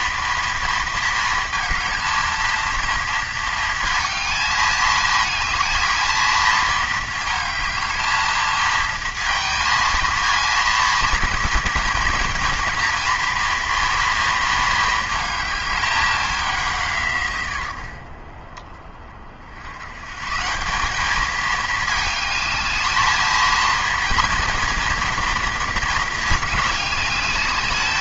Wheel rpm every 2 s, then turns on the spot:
230, 230, 220, 230, 220, 230, 240, 230, 190, 50, 150, 220, 240, 220.
none